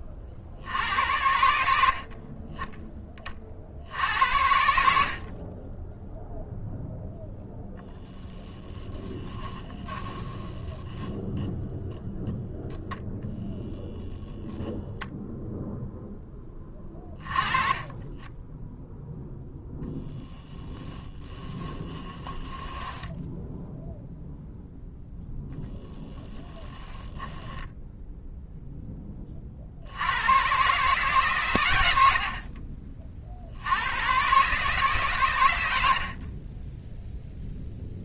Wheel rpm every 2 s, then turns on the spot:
70, 20, 60, 0, 10, 10, 10, 0, 20, 0, 10, 10, 0, 10, 10, 130, 40, 130, 10.
8-12 22-24 26-28